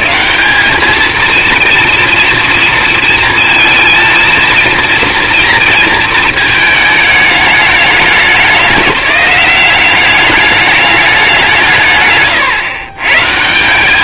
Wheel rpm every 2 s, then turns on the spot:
70, 230, 230, 230, 190, 200, 160.
none